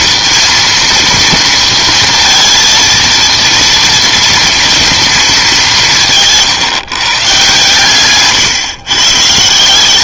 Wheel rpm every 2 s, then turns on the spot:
230, 230, 230, 150, 130.
none